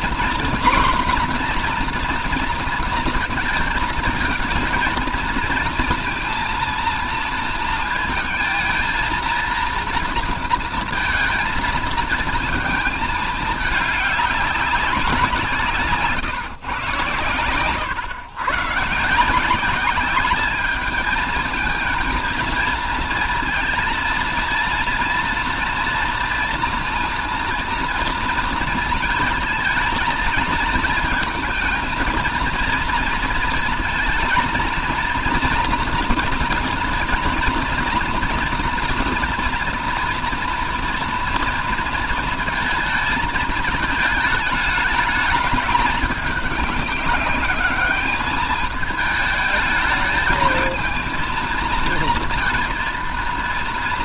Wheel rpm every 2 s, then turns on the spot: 240, 230, 230, 230, 230, 230, 220, 200, 130, 120, 210, 230, 230, 240, 230, 230, 230, 220, 230, 230, 230, 220, 210, 210, 210, 220, 230.
none